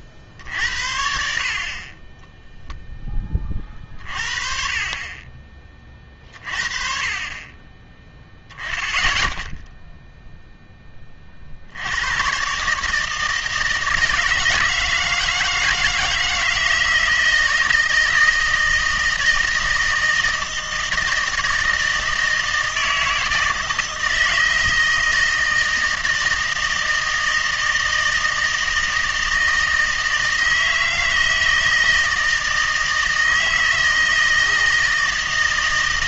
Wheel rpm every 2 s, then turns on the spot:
70, 0, 30, 40, 10, 10, 150, 160, 160, 160, 160, 160, 160, 160, 160, 160, 160, 160.
none